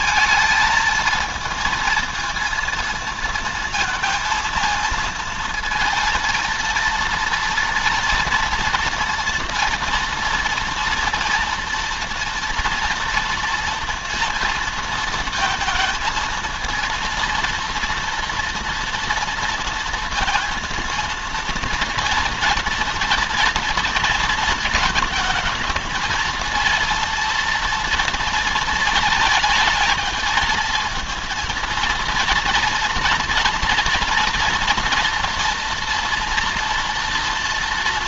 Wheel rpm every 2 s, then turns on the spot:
220, 230, 230, 230, 240, 240, 230, 230, 230, 230, 230, 240, 230, 230, 220, 230, 230, 230, 230.
none